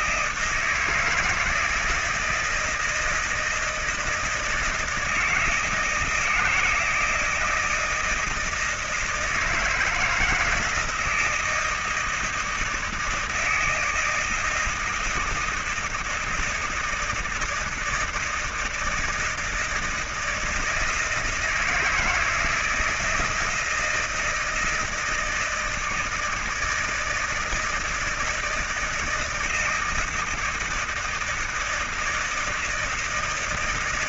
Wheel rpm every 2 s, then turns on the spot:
160, 160, 160, 160, 160, 160, 170, 160, 160, 160, 160, 160, 160, 160, 160, 160, 160.
none